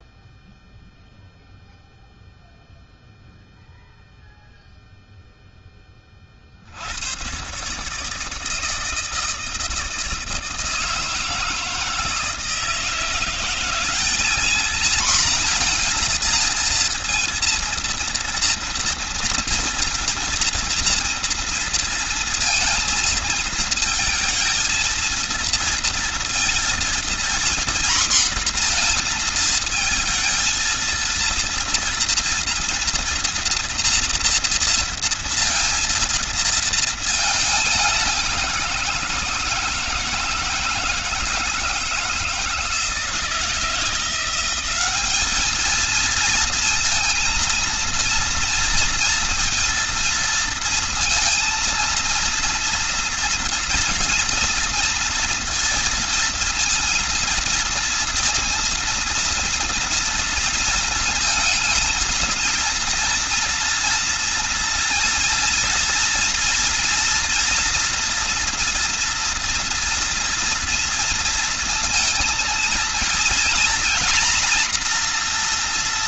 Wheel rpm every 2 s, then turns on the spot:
0, 0, 0, 100, 160, 160, 170, 230, 230, 230, 230, 220, 230, 240, 230, 230, 230, 230, 220, 170, 160, 160, 200, 230, 230, 230, 230, 230, 230, 230, 220, 230, 230, 240, 230, 230, 230, 240.
none